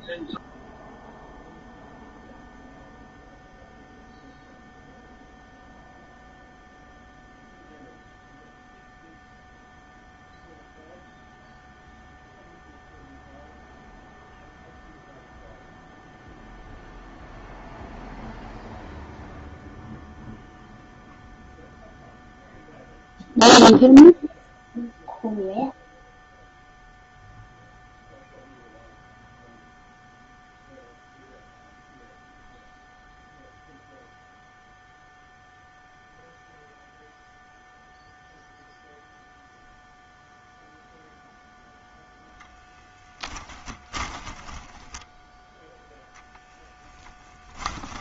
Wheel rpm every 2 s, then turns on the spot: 0, 0, 0, 0, 0, 0, 0, 0, 0, 0, 0, 0, 0, 0, 0, 0, 0, 0, 0, 0, 0, 10, 10, 10.
42-46